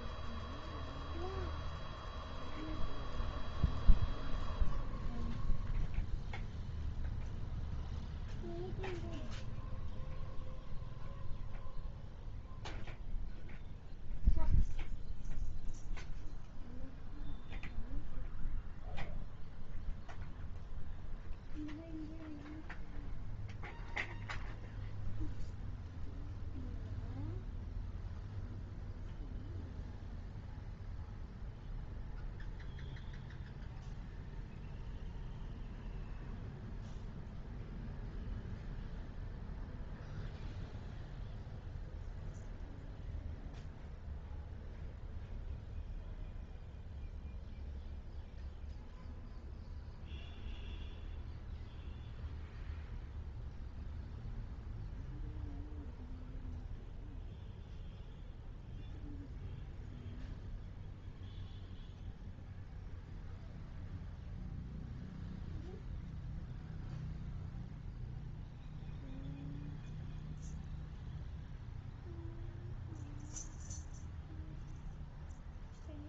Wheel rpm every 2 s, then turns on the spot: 0, 0, 0, 0, 0, 0, 0, 0, 0, 0, 0, 0, 0, 0, 0, 0, 0, 0, 0, 0, 0, 0, 0, 0, 0, 0, 0, 0, 0, 0, 0, 0, 0, 0, 0, 0, 0, 0.
none